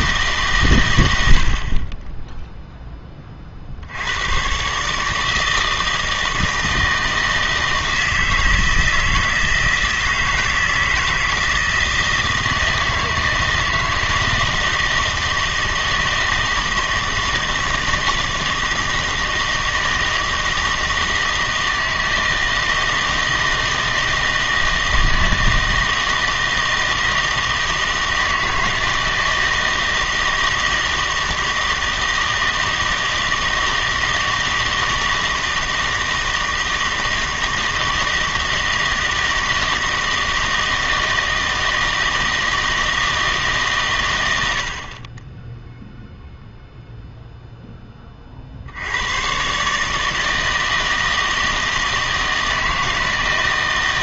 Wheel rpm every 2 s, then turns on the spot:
130, 10, 130, 160, 160, 160, 160, 160, 160, 160, 160, 160, 160, 160, 160, 160, 160, 160, 160, 160, 160, 160, 70, 0, 60, 160, 160.
none